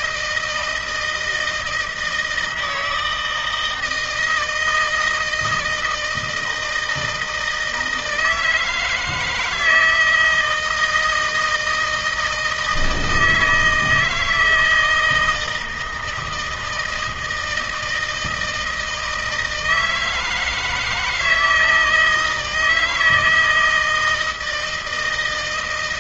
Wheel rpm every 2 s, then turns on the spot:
160, 160, 160, 160, 160, 170, 160, 160, 160, 160, 160, 160, 160.
none